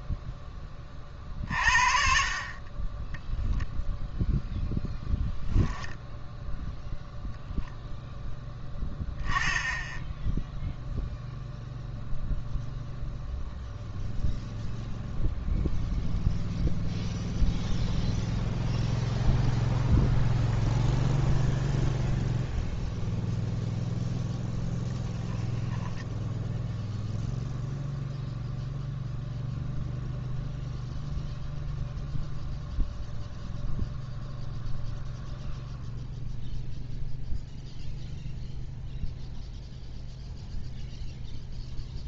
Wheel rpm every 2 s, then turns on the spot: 40, 20, 10, 0, 10, 0, 0, 0, 0, 0, 0, 0, 10, 0, 0, 0, 0, 0, 0, 0, 0.
24-26